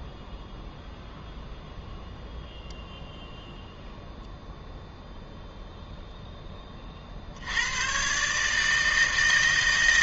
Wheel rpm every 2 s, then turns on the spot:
0, 0, 0, 20, 150.
none